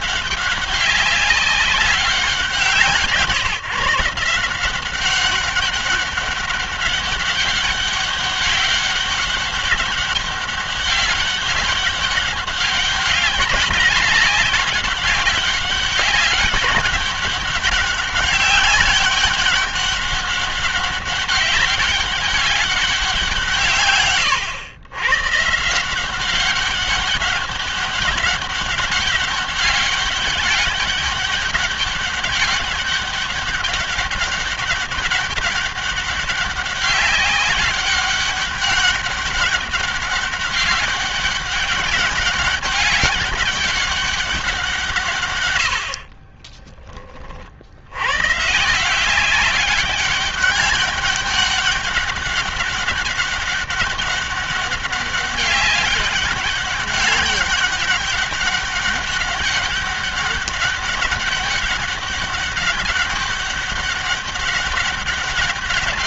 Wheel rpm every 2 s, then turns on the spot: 200, 170, 180, 200, 200, 200, 190, 200, 200, 200, 200, 190, 110, 200, 200, 200, 200, 200, 200, 200, 200, 200, 150, 30, 160, 200, 200, 200, 200, 200, 200, 200, 200.
none